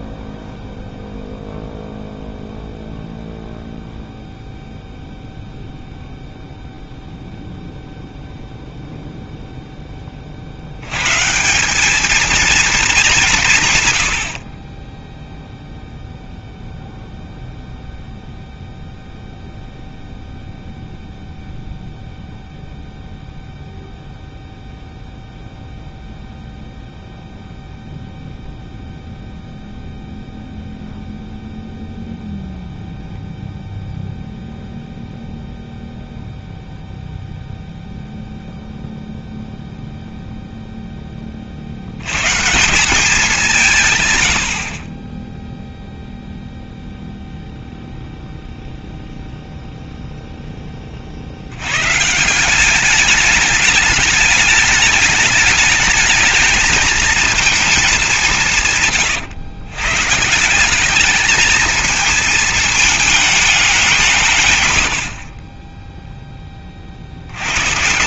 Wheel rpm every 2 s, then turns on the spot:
0, 0, 0, 0, 0, 80, 220, 30, 0, 0, 0, 0, 0, 0, 0, 0, 0, 0, 0, 0, 0, 180, 30, 0, 0, 30, 200, 210, 220, 150, 190, 220, 100, 40.
none